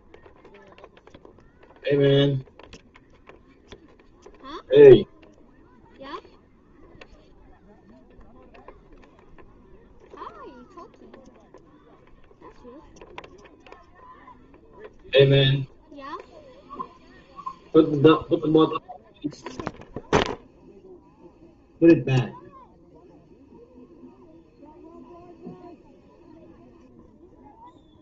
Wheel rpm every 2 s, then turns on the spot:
0, 0, 0, 0, 0, 0, 0, 0, 0, 0, 0, 0, 0, 0.
none